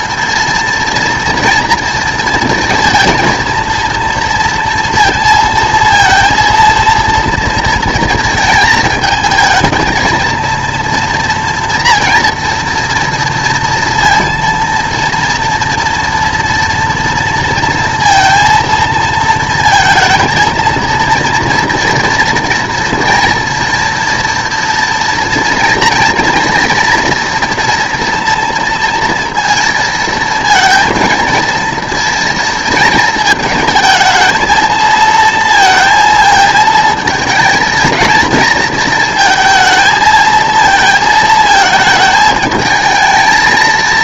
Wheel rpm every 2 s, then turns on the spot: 230, 230, 230, 230, 220, 230, 240, 230, 230, 230, 230, 240, 230, 230, 230, 230, 230, 220, 220, 230, 220, 220.
none